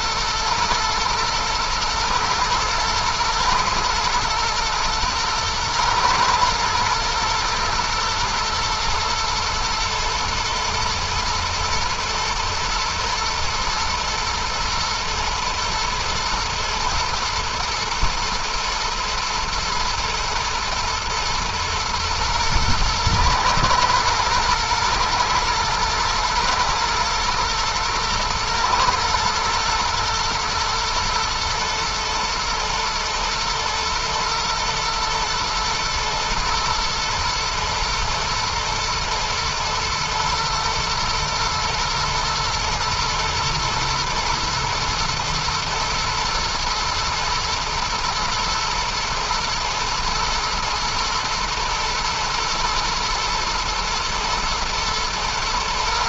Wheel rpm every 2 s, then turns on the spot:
110, 110, 120, 110, 110, 120, 120, 120, 120, 120, 120, 110, 110, 110, 120, 120, 110, 120, 110, 120, 110, 120, 120, 110, 120, 120, 120, 120.
none